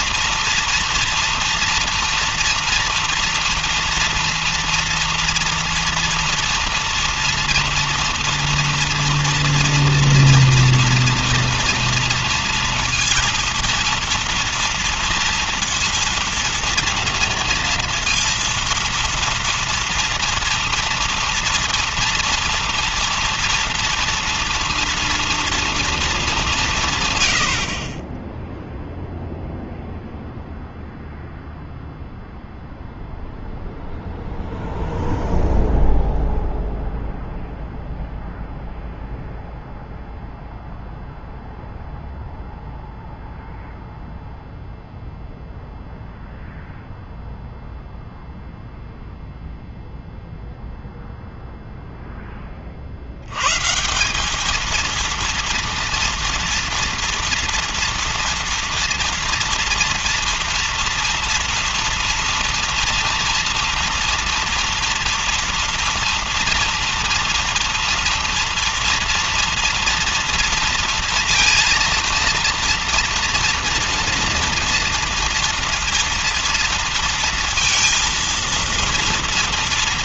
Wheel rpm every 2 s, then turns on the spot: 230, 230, 230, 230, 230, 240, 230, 230, 230, 230, 230, 230, 230, 190, 10, 0, 0, 0, 0, 0, 0, 0, 0, 0, 0, 0, 20, 200, 230, 230, 230, 230, 230, 230, 230, 230, 230, 240, 230, 230.
none